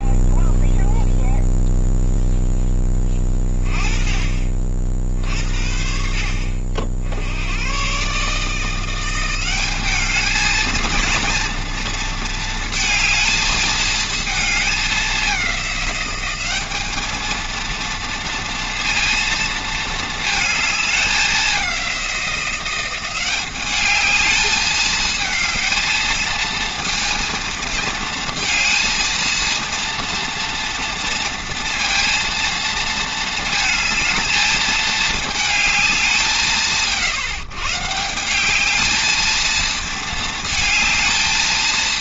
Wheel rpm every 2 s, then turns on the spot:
0, 10, 50, 60, 170, 230, 220, 210, 210, 230, 220, 180, 210, 230, 230, 230, 220, 220, 160, 210, 220.
none